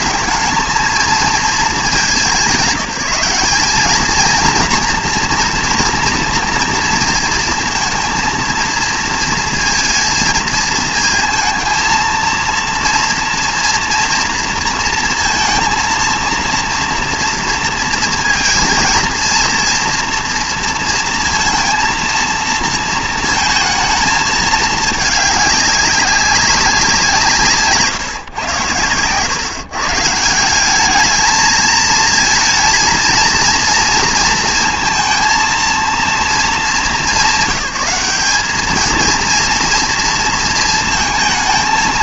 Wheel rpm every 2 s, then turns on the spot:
200, 180, 230, 230, 230, 220, 230, 230, 230, 230, 230, 230, 210, 190, 110, 190, 230, 230, 210, 210, 230.
none